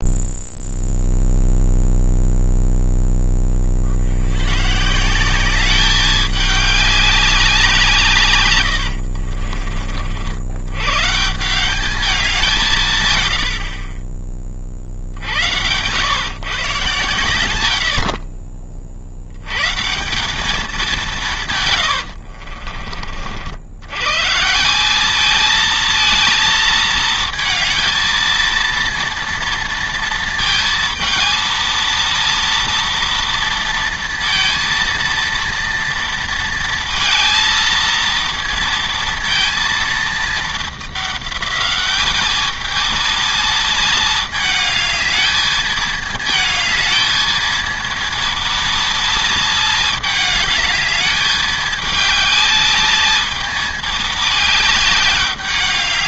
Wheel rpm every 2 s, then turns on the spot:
0, 0, 120, 200, 110, 100, 170, 40, 130, 40, 200, 50, 170, 220, 230, 230, 230, 230, 230, 230, 210, 210, 220, 220, 230, 210, 220, 210.
8-10 22-24